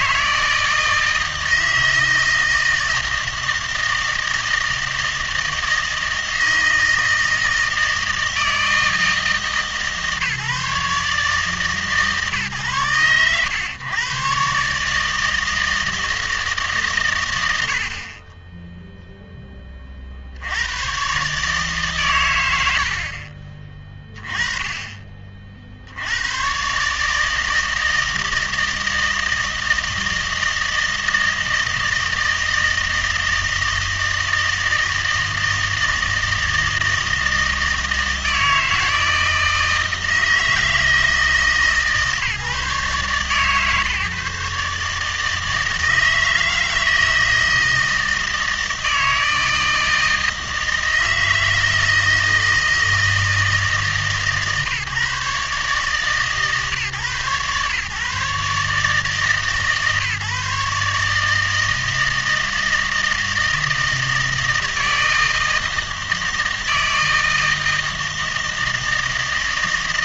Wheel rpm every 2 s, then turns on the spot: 160, 160, 160, 160, 160, 140, 130, 140, 150, 10, 90, 100, 10, 120, 160, 160, 160, 160, 160, 160, 160, 150, 140, 160, 160, 160, 160, 140, 130, 150, 150, 160, 160, 160, 160.
none